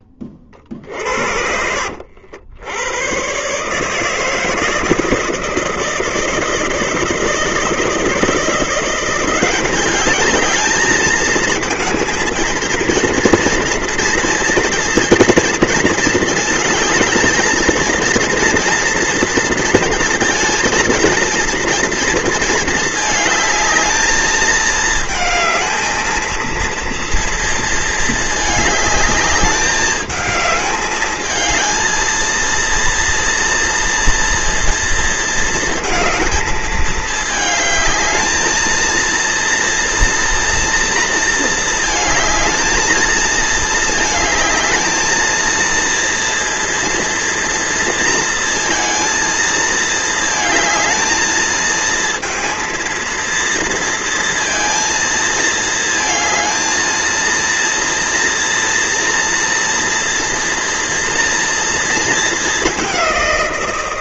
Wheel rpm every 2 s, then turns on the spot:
40, 90, 160, 160, 170, 220, 230, 230, 220, 230, 230, 220, 220, 230, 210, 210, 230, 230, 220, 220, 230, 220, 220, 230, 230, 220, 230, 230, 220, 230, 230, 200.
none